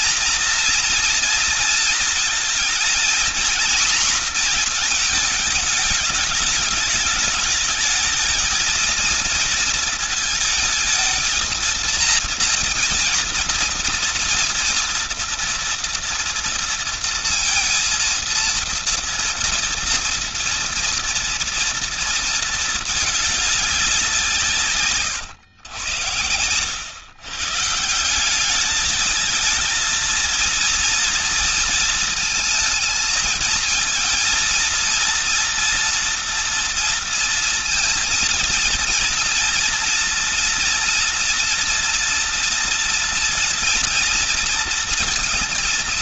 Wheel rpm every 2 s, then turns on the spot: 240, 230, 230, 210, 230, 220, 230, 230, 230, 230, 230, 220, 150, 120, 200, 230, 220, 230, 230, 230, 230, 230, 230.
none